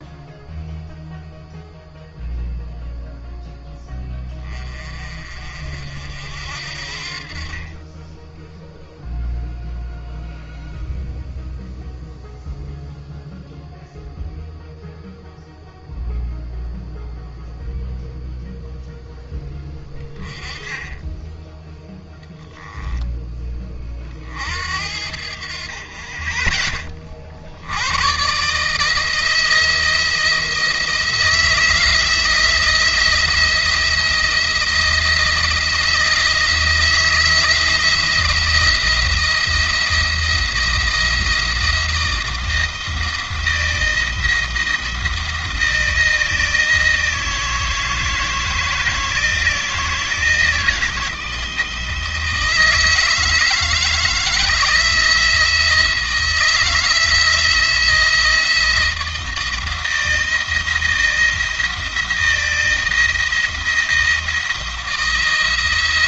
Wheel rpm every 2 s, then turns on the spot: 0, 0, 30, 50, 0, 0, 0, 0, 0, 0, 10, 10, 60, 30, 150, 160, 170, 170, 160, 170, 170, 160, 170, 160, 160, 160, 160, 160, 170, 160, 160, 170, 170.
none